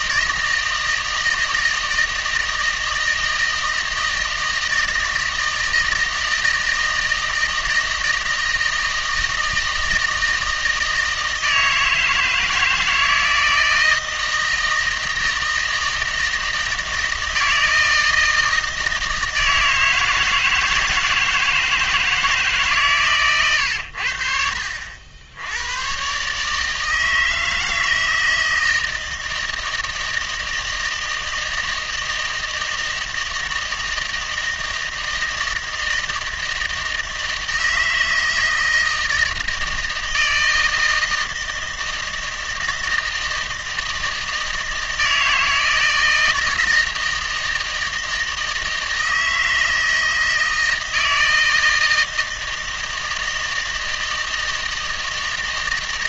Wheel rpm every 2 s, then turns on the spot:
160, 160, 160, 160, 160, 160, 160, 160, 160, 160, 160, 140, 70, 150, 160, 160, 160, 160, 160, 160, 160, 160, 160, 160, 160, 160, 160, 160.
none